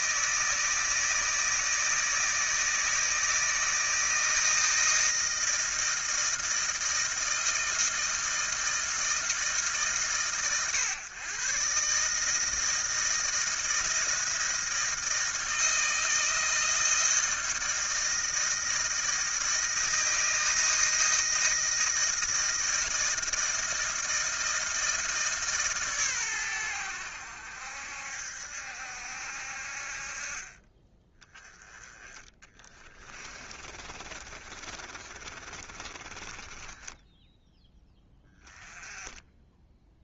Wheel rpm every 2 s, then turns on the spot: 160, 160, 160, 160, 160, 110, 160, 160, 160, 160, 160, 160, 160, 110, 70, 30, 20, 40, 20, 20.
32-38